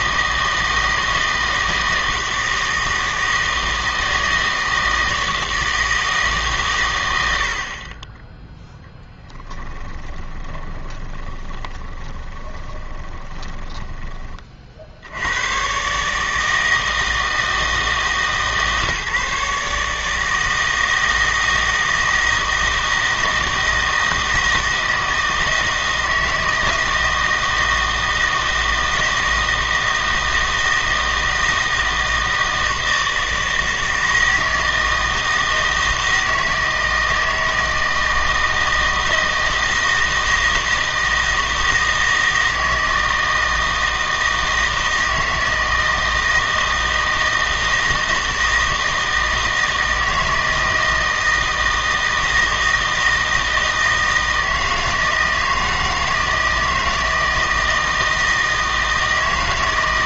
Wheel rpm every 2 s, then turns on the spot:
160, 160, 160, 140, 20, 20, 20, 50, 160, 140, 160, 160, 160, 160, 160, 160, 160, 160, 160, 160, 160, 160, 160, 160, 160, 160, 160, 160, 160, 160.
8-14